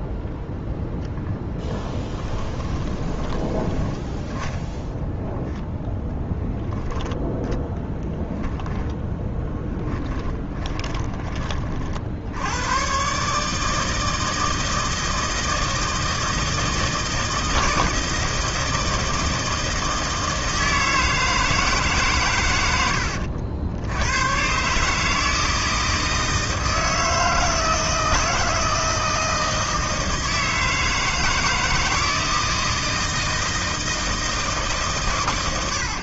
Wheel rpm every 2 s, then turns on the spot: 10, 20, 0, 0, 0, 20, 110, 160, 160, 160, 160, 90, 140, 160, 160, 160, 160, 140.
2-4 10-12